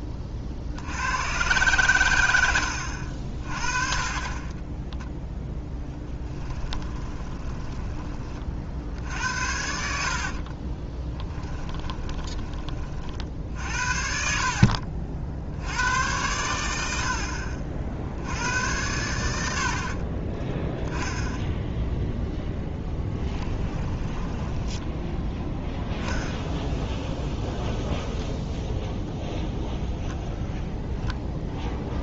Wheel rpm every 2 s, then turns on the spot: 70, 70, 20, 20, 60, 20, 40, 60, 80, 100, 10, 10, 10, 0, 0, 0.
4-8 10-12 22-24